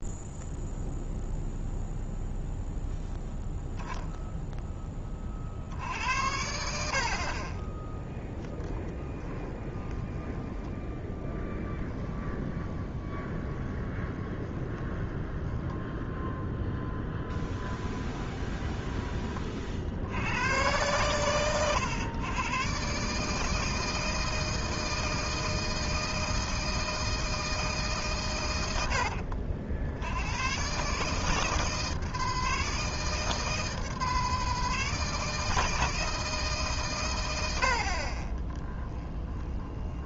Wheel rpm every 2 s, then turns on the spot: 0, 0, 10, 60, 10, 10, 20, 20, 0, 20, 120, 140, 160, 160, 90, 140, 160, 160, 130, 10.
8-16 18-20 38-40